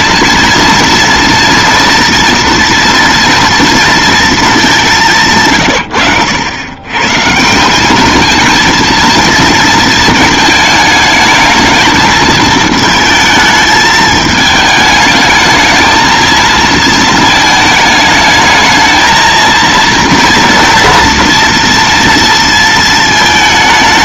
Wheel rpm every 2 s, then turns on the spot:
230, 230, 200, 120, 220, 220, 220, 220, 220, 220, 230, 220.
none